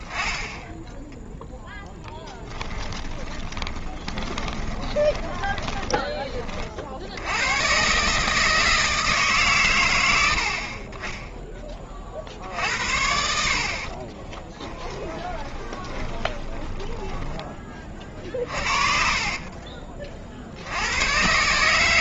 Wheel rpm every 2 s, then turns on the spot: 10, 10, 20, 60, 160, 30, 70, 10, 20, 40, 80.
2-6 14-20